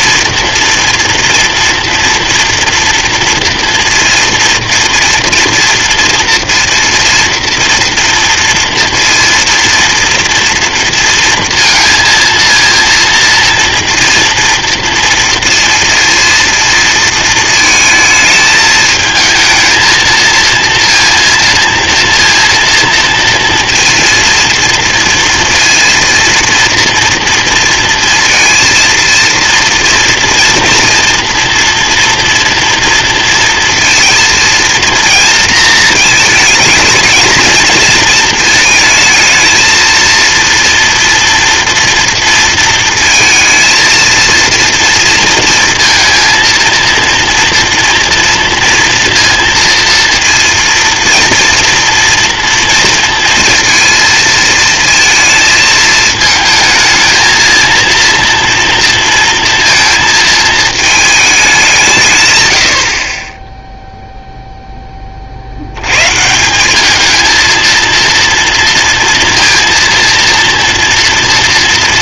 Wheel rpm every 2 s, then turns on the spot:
230, 230, 230, 230, 230, 230, 230, 230, 230, 220, 230, 230, 230, 230, 230, 230, 230, 230, 230, 220, 230, 230, 230, 230, 230, 230, 230, 230, 220, 230, 220, 110, 0, 170, 240, 230.
none